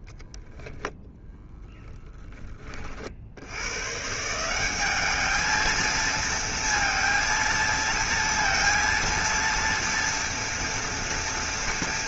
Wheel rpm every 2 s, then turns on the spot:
0, 20, 150, 230, 230, 230.
2-4